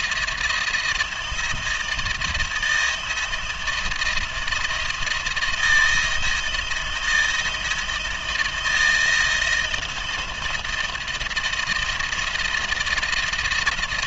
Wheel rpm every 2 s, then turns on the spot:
160, 170, 160, 170, 170, 170, 170.
none